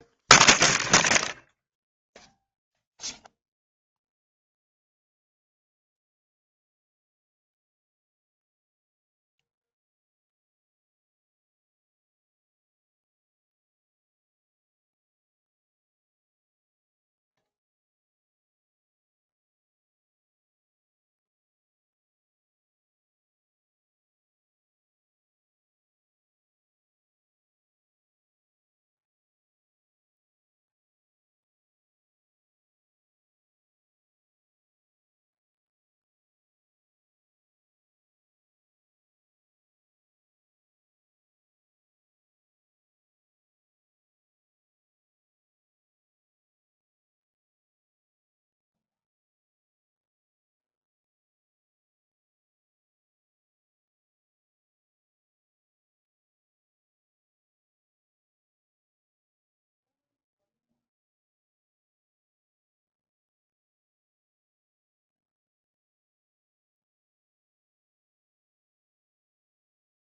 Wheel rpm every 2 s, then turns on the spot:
0, 0, 0, 0, 0, 0, 0, 0, 0, 0, 0, 0, 0, 0, 0, 0, 0, 0, 0, 0, 0, 0, 0, 0, 0, 0, 0, 0, 0, 0, 0, 0, 0, 0, 0.
none